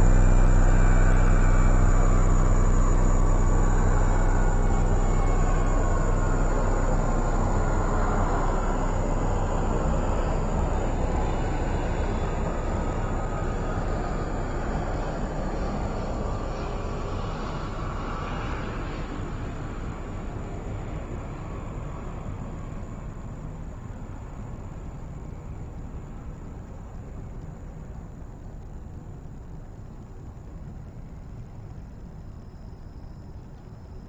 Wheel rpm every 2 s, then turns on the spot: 0, 0, 0, 0, 0, 0, 0, 0, 0, 0, 0, 0, 0, 0, 0, 0, 0.
none